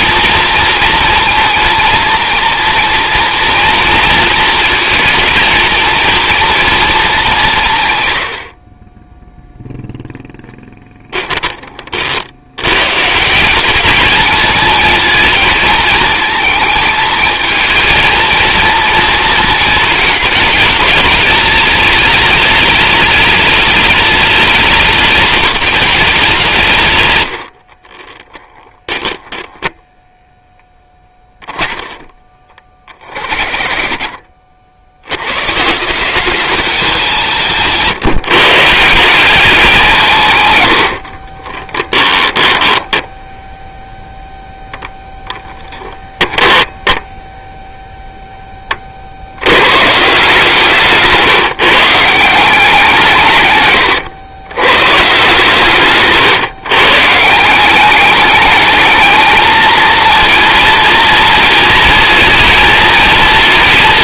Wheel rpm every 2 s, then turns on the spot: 230, 230, 220, 220, 20, 10, 130, 220, 220, 230, 210, 210, 210, 120, 10, 10, 40, 90, 190, 160, 70, 10, 0, 0, 20, 160, 170, 130, 140, 210, 230, 230.
10-12 28-30 40-42 50-52